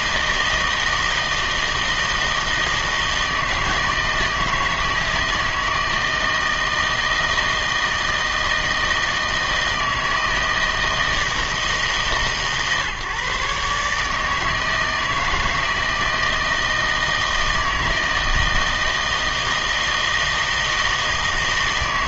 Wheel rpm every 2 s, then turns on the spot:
160, 160, 160, 160, 160, 160, 150, 160, 160, 160, 160.
none